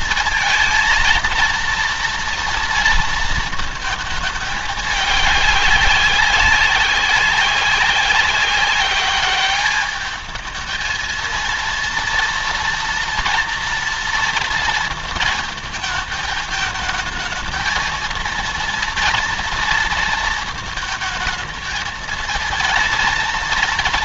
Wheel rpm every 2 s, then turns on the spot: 230, 230, 210, 190, 190, 220, 230, 230, 220, 230, 230, 230.
none